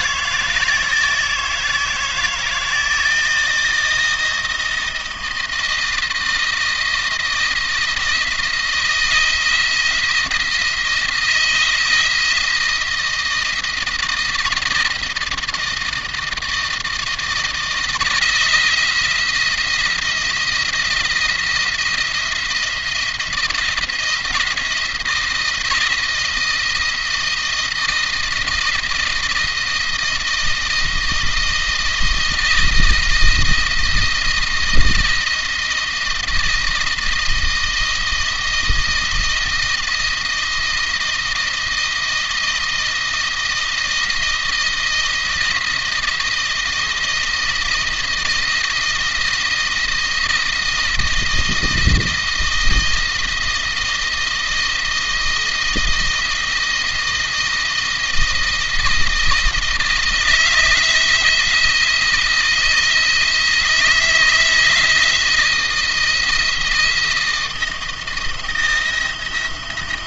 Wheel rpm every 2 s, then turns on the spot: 160, 160, 170, 160, 160, 170, 170, 170, 160, 160, 170, 170, 170, 160, 160, 170, 170, 170, 170, 170, 170, 160, 170, 170, 170, 170, 170, 170, 160, 160, 170, 160, 170, 160, 170.
none